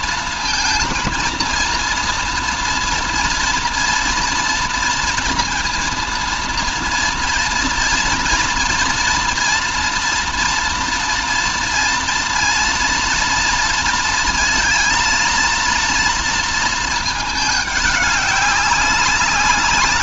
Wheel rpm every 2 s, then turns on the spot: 230, 230, 230, 230, 230, 230, 230, 230, 220, 190.
none